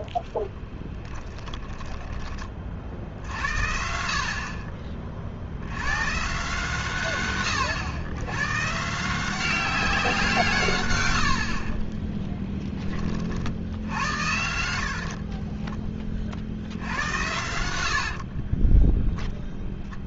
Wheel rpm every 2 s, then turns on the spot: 10, 40, 40, 140, 130, 130, 10, 80, 50, 30.
0-2 14-16 18-20